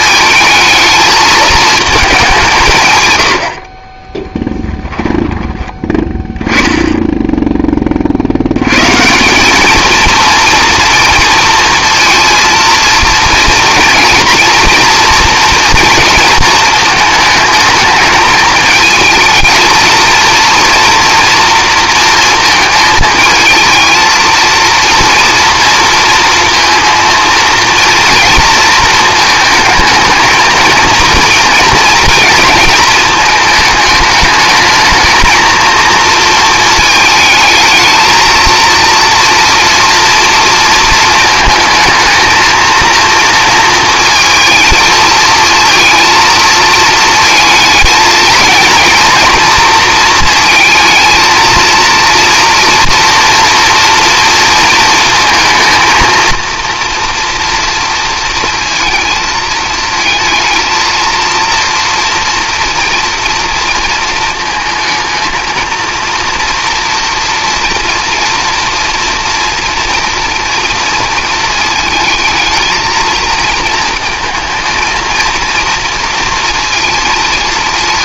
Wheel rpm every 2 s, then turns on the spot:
220, 140, 10, 10, 120, 230, 230, 230, 220, 220, 230, 220, 230, 230, 230, 230, 220, 220, 220, 230, 230, 230, 230, 230, 230, 230, 230, 230, 230, 230, 230, 230, 220, 240, 230, 230, 230, 220, 220.
4-6